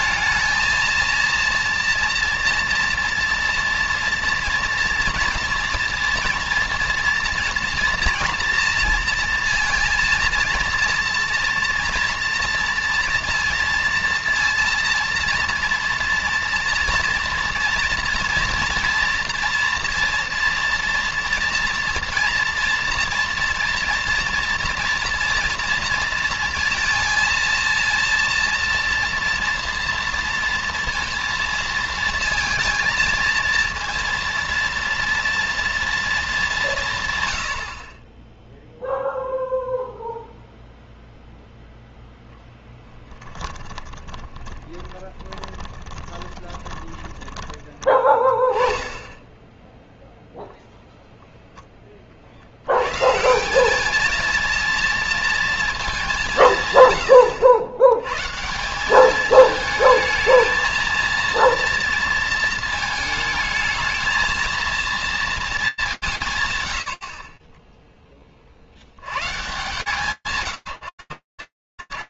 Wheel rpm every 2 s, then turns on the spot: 230, 230, 230, 230, 230, 230, 230, 230, 230, 230, 230, 240, 240, 230, 230, 230, 230, 230, 130, 0, 0, 10, 10, 10, 10, 0, 150, 230, 110, 210, 230, 220, 230, 60, 110, 170.
42-48